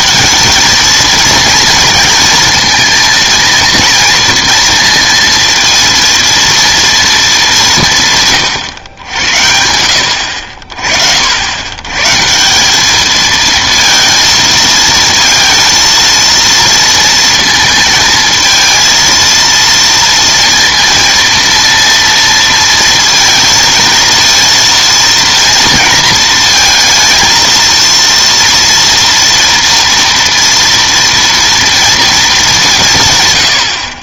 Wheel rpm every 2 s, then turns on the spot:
220, 230, 230, 230, 120, 50, 180, 230, 230, 230, 230, 230, 230, 230, 230, 230, 180.
none